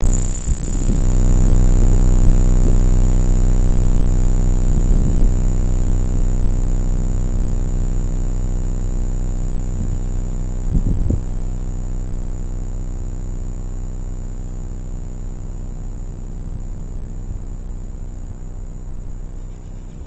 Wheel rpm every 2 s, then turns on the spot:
0, 0, 0, 0, 0, 0, 0, 0, 0, 0.
none